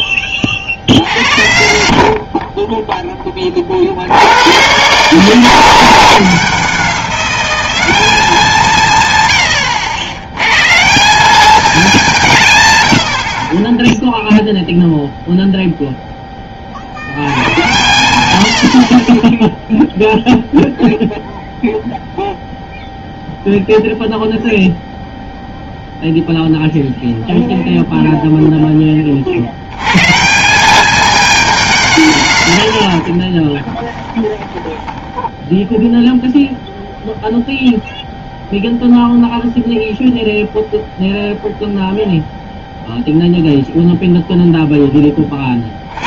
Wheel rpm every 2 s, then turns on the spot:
50, 30, 110, 160, 150, 130, 140, 0, 30, 80, 0, 0, 0, 0, 10, 190, 140, 10, 0, 0, 0, 0, 0.
34-36